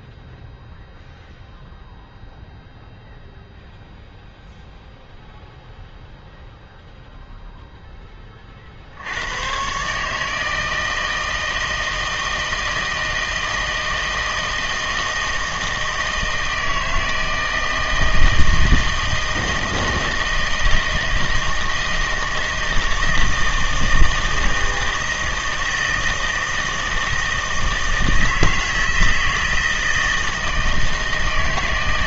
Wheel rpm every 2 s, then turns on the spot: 0, 0, 0, 0, 40, 160, 160, 160, 160, 160, 160, 160, 160, 160, 160, 160.
none